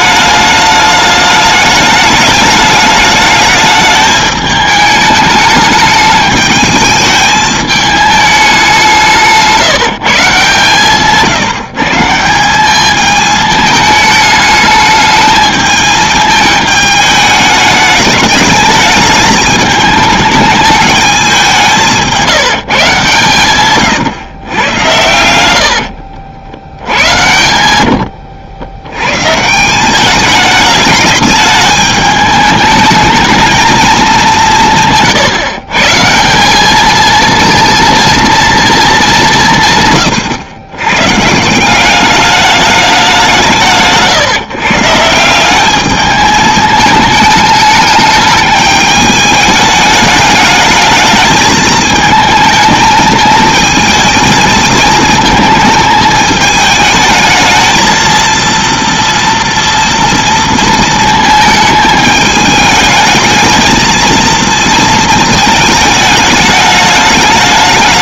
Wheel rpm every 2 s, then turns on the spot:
210, 210, 210, 210, 200, 160, 190, 210, 210, 210, 210, 170, 110, 70, 100, 210, 210, 170, 190, 230, 120, 200, 150, 210, 210, 210, 220, 220, 220, 230, 230, 220, 220, 210.
none